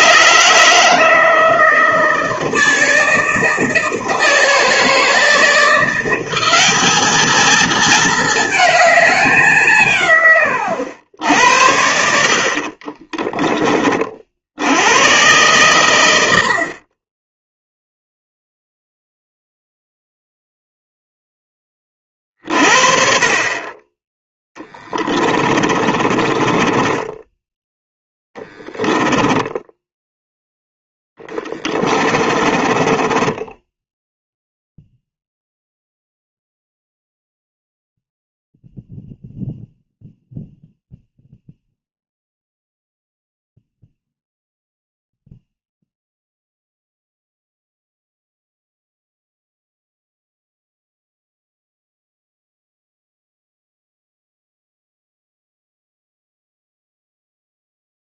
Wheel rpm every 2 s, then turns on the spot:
160, 160, 160, 210, 220, 100, 40, 100, 30, 0, 0, 50, 10, 10, 10, 10, 20, 0, 0, 0, 0, 0, 0, 0, 0, 0, 0, 0, 0.
12-14 24-30 32-34